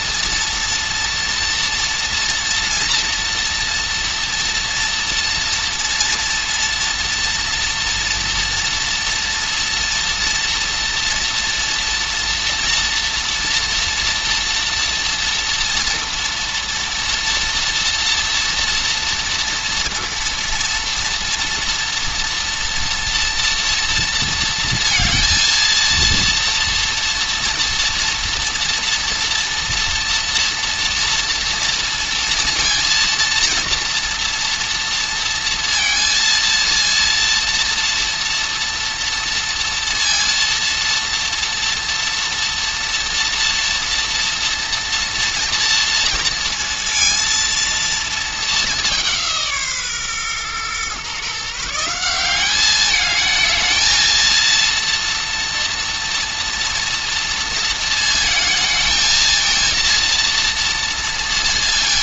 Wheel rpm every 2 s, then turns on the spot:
230, 230, 230, 230, 240, 240, 230, 230, 230, 240, 240, 240, 230, 230, 230, 230, 230, 230, 230, 230, 230, 230, 230, 230, 210, 120, 210, 230, 230, 220, 230.
none